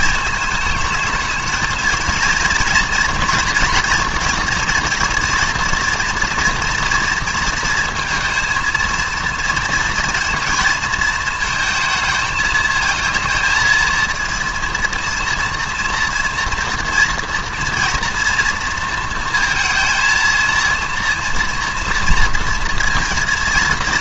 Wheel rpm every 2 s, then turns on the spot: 220, 230, 230, 240, 230, 230, 220, 230, 230, 230, 230, 230.
none